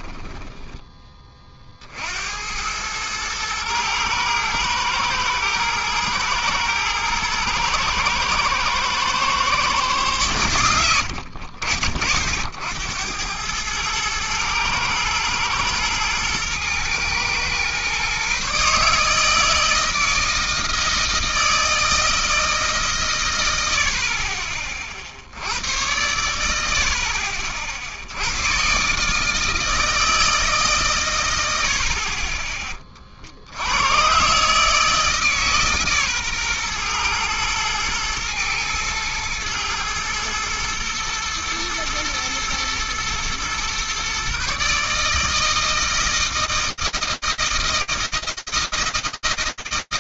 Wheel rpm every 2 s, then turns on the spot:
30, 110, 110, 110, 120, 80, 90, 120, 120, 150, 160, 130, 50, 70, 140, 130, 20, 150, 120, 110, 110, 120, 150, 160, 160.
10-12